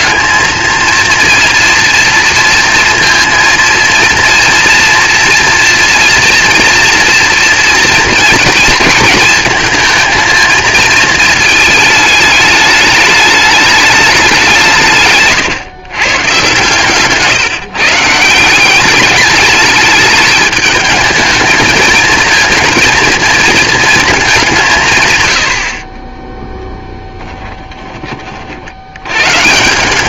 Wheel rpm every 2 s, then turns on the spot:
230, 230, 230, 240, 230, 220, 210, 180, 130, 180, 210, 230, 180, 10, 50.
26-28